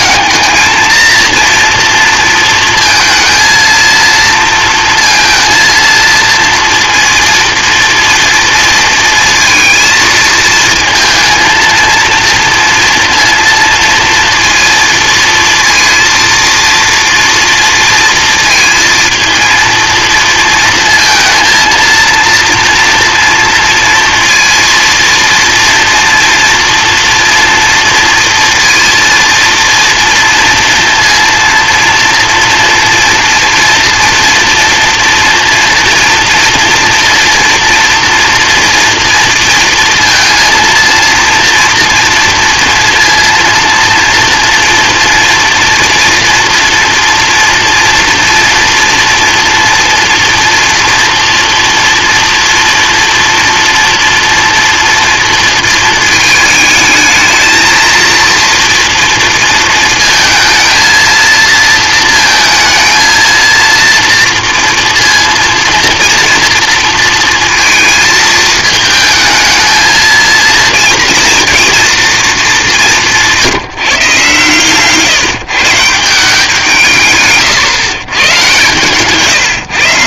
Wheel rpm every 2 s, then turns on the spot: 220, 230, 230, 230, 230, 220, 230, 230, 230, 230, 230, 230, 230, 230, 230, 240, 230, 230, 230, 230, 230, 230, 230, 230, 230, 230, 230, 240, 220, 230, 220, 220, 240, 230, 220, 230, 200, 140, 160, 130.
74-76